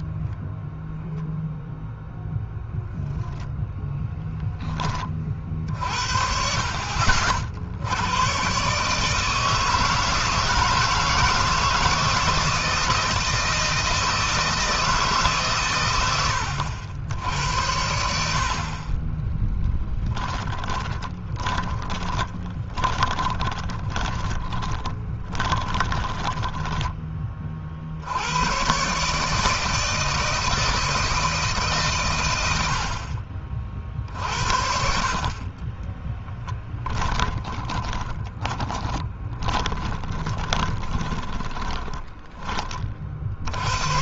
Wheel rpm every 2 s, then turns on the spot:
0, 0, 20, 60, 140, 160, 160, 160, 80, 40, 10, 20, 20, 10, 120, 160, 70, 50, 10, 20, 30, 40.
20-26 36-42